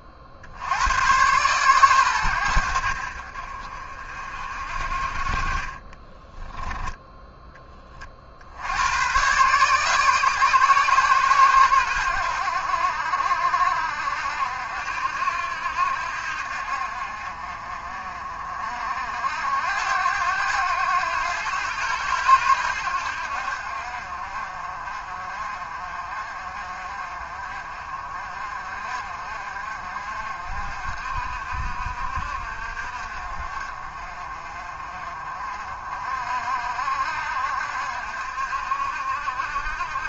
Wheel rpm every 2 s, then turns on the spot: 100, 70, 50, 10, 100, 120, 70, 70, 50, 60, 100, 80, 50, 40, 50, 50, 50, 40, 60, 60.
none